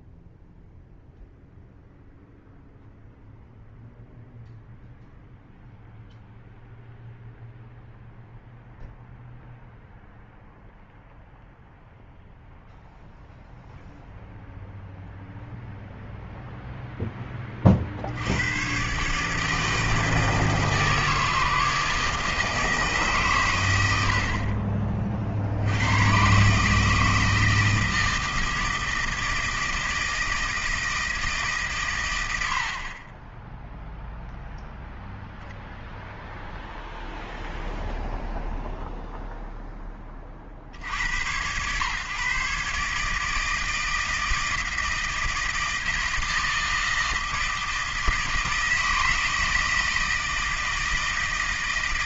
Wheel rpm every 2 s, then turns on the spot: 0, 0, 0, 0, 0, 0, 0, 0, 0, 130, 160, 150, 30, 150, 160, 160, 50, 0, 0, 0, 60, 140, 160, 160, 160, 160.
none